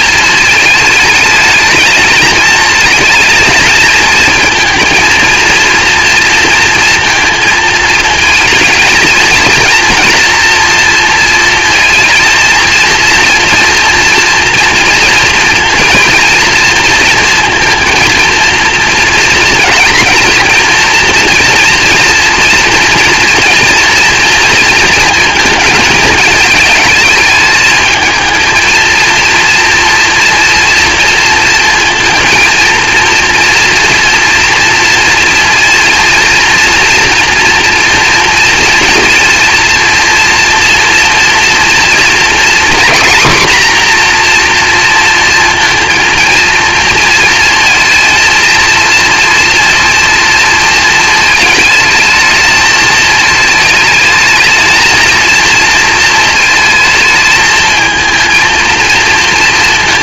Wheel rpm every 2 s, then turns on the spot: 220, 220, 230, 230, 230, 230, 220, 230, 230, 230, 230, 230, 230, 220, 230, 230, 230, 230, 230, 230, 230, 230, 240, 230, 230, 230, 220, 220, 220, 230.
none